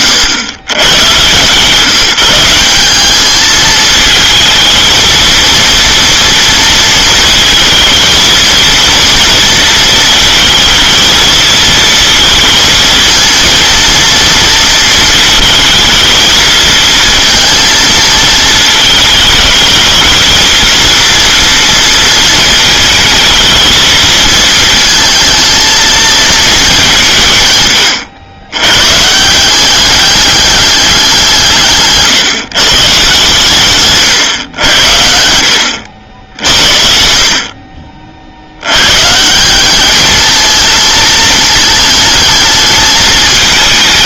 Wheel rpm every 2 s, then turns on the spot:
120, 190, 220, 230, 230, 220, 220, 230, 230, 220, 230, 220, 220, 180, 110, 200, 150, 100, 70, 90, 220, 220.
none